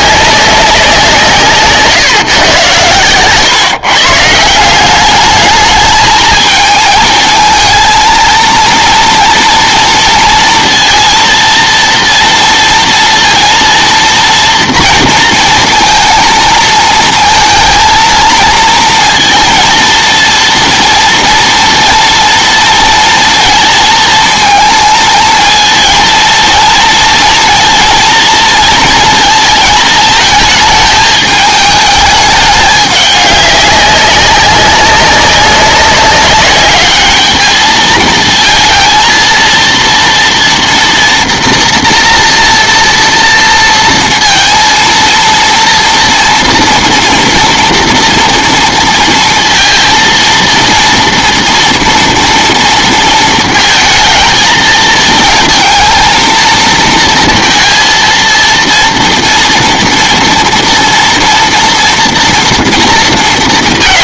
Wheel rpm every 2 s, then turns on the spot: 180, 110, 190, 220, 230, 230, 230, 230, 220, 230, 230, 230, 220, 230, 230, 220, 200, 200, 210, 230, 230, 230, 230, 230, 230, 230, 230, 220, 230, 230, 230, 230.
none